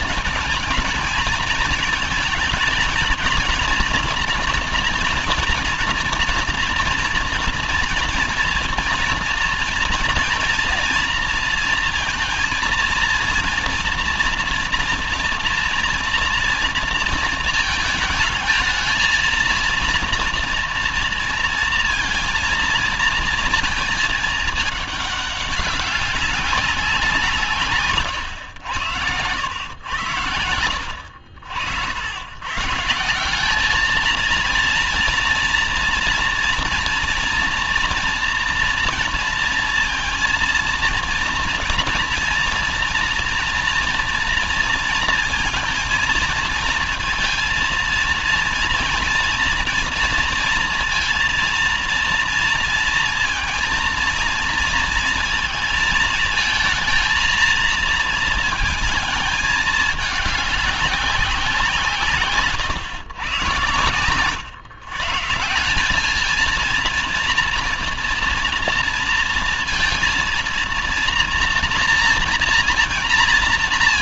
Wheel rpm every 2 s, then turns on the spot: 230, 220, 230, 230, 230, 230, 230, 230, 230, 230, 230, 220, 200, 170, 100, 70, 170, 230, 230, 230, 230, 230, 230, 230, 230, 230, 230, 230, 220, 220, 180, 130, 160, 230, 230, 230, 230.
none